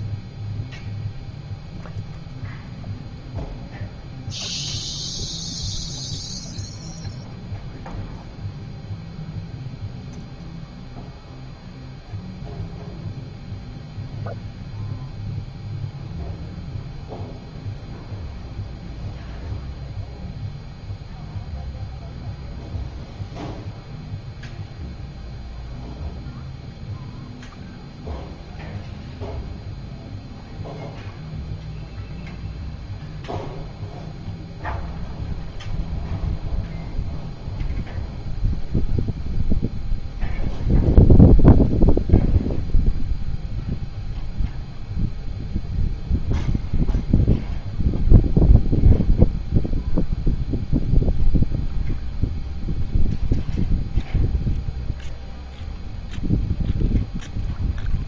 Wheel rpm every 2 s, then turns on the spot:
0, 0, 0, 0, 0, 0, 0, 0, 0, 0, 0, 0, 0, 0, 0, 0, 0, 0, 0, 0, 0, 0, 0, 0, 0, 0, 0, 0, 0.
none